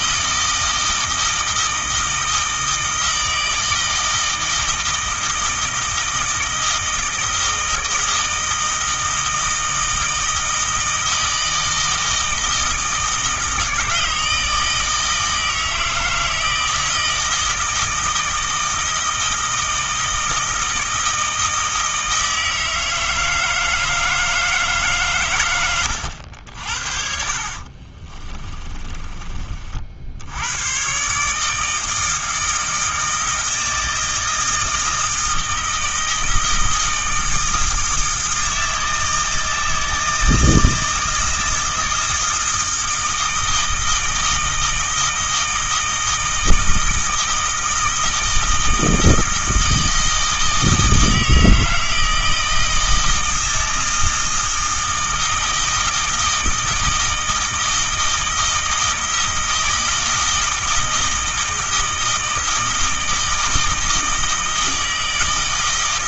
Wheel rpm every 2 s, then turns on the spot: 160, 160, 160, 160, 160, 160, 160, 160, 160, 160, 160, 160, 140, 50, 20, 130, 160, 160, 160, 160, 160, 160, 160, 160, 160, 160, 160, 160, 160, 160, 160, 160, 160.
28-30